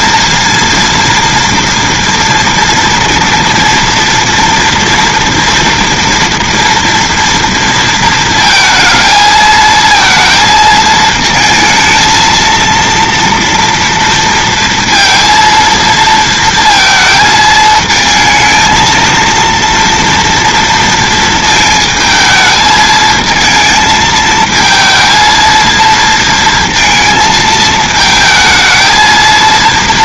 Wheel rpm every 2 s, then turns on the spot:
230, 240, 230, 230, 230, 220, 230, 230, 230, 230, 230, 220, 220, 230, 220.
none